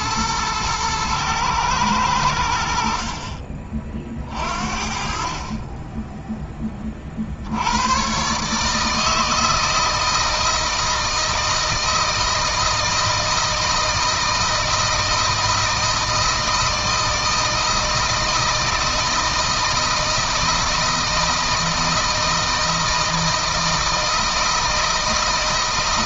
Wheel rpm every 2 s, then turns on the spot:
110, 70, 50, 20, 140, 160, 160, 160, 160, 160, 160, 160, 160.
none